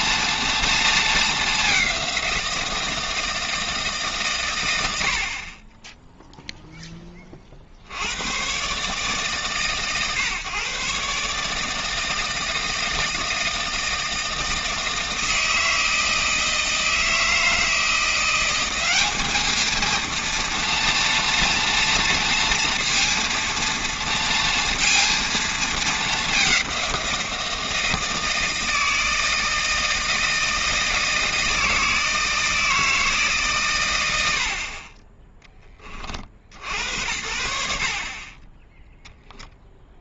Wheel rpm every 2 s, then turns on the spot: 230, 170, 80, 0, 130, 130, 160, 160, 160, 190, 230, 230, 230, 190, 160, 160, 160, 40, 80, 10.
none